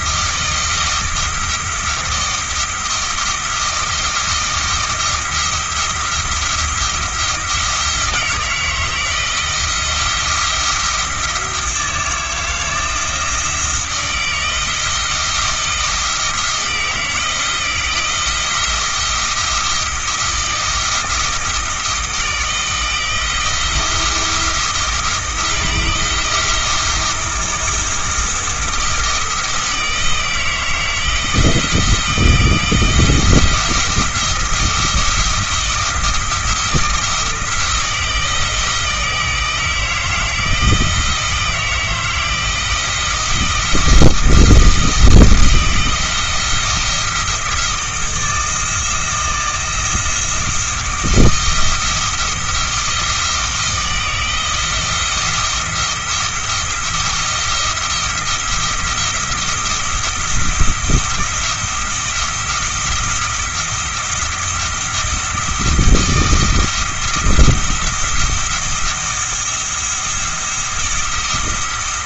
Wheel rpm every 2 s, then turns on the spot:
170, 170, 170, 170, 160, 170, 170, 160, 160, 170, 170, 160, 170, 170, 160, 160, 160, 170, 170, 160, 160, 160, 160, 170, 160, 160, 170, 170, 170, 170, 170, 170, 170, 170, 170, 170.
none